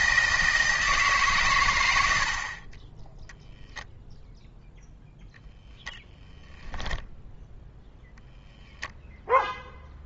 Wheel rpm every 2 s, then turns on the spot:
150, 20, 0, 10, 0.
none